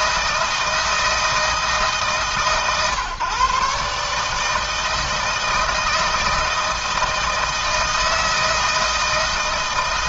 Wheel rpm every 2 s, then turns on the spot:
160, 130, 160, 160, 160.
none